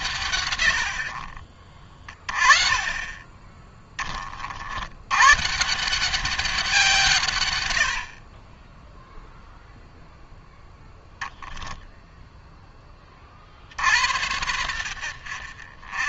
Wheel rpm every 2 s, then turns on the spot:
80, 30, 80, 170, 10, 0, 20, 80.
none